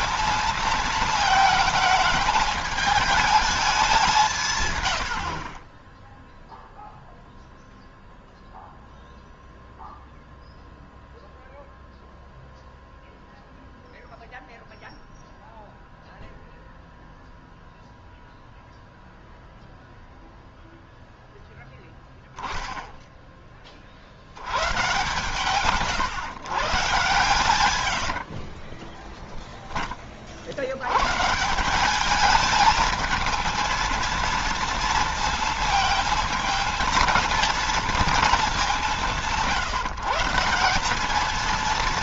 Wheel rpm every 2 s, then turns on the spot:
230, 220, 130, 0, 0, 0, 0, 0, 0, 0, 0, 0, 110, 130, 60, 90, 220, 230, 230, 200, 180.
28-30